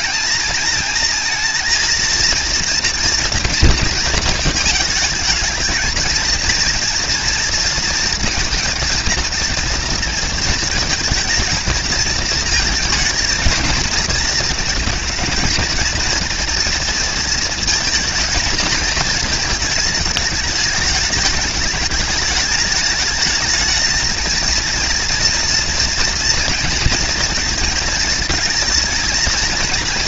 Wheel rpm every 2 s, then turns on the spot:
220, 230, 220, 230, 230, 220, 220, 230, 230, 220, 210, 210, 230, 230, 230.
none